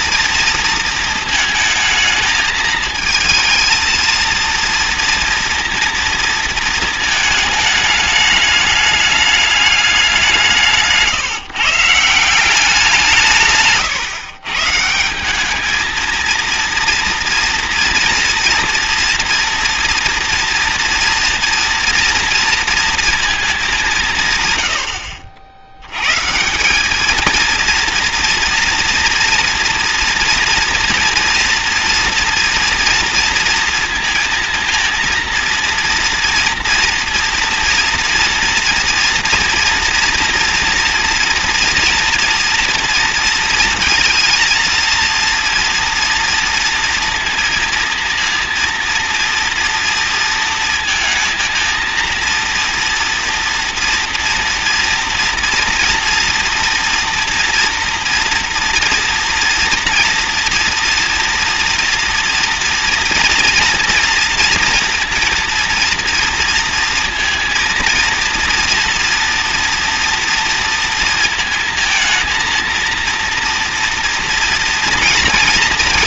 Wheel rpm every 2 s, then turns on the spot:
230, 220, 230, 230, 210, 170, 180, 120, 230, 230, 230, 230, 140, 140, 230, 240, 230, 230, 230, 230, 230, 230, 220, 230, 230, 230, 230, 230, 230, 230, 230, 230, 230, 230, 230, 240, 230, 240.
none